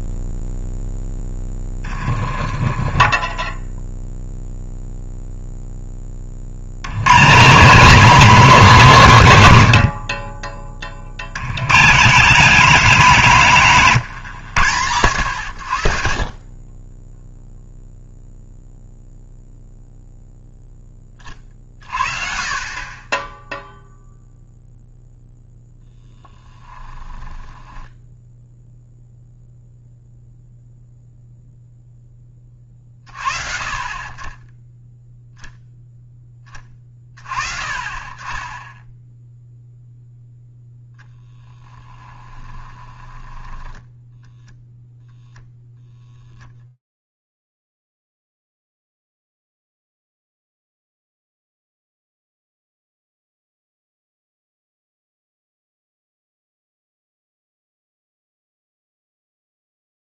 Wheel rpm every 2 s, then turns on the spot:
0, 20, 0, 80, 200, 30, 200, 110, 20, 0, 10, 30, 0, 20, 0, 0, 30, 20, 20, 10, 10, 30, 0, 0, 0, 90, 60, 80, 0, 0.
2-4 16-18 26-28 42-44